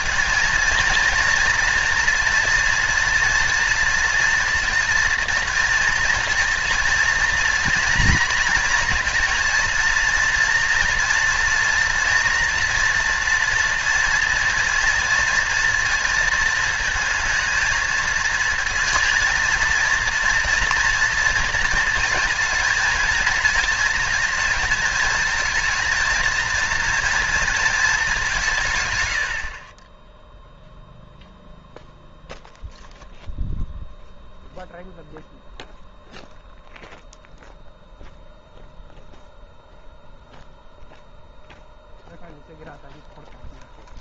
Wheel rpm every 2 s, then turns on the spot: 230, 230, 230, 230, 230, 230, 240, 230, 220, 230, 230, 230, 230, 230, 130, 0, 0, 0, 0, 0, 0, 0.
none